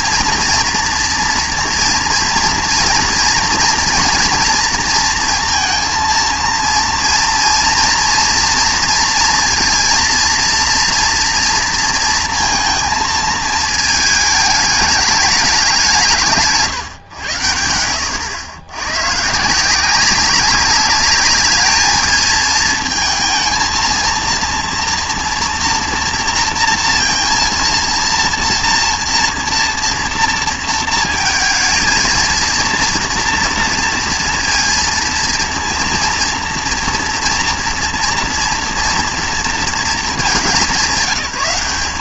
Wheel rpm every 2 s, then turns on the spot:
240, 230, 230, 230, 230, 230, 220, 210, 150, 80, 200, 220, 230, 230, 230, 230, 230, 230, 230, 230, 190.
none